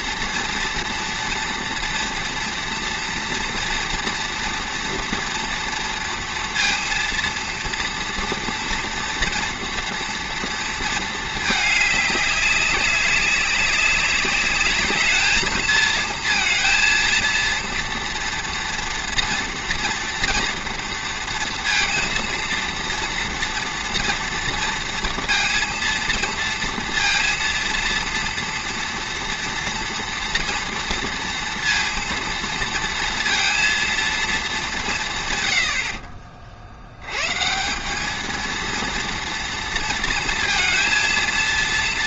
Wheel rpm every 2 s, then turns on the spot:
240, 240, 230, 230, 230, 230, 200, 210, 230, 230, 230, 230, 230, 230, 230, 230, 230, 200, 70, 230, 230.
none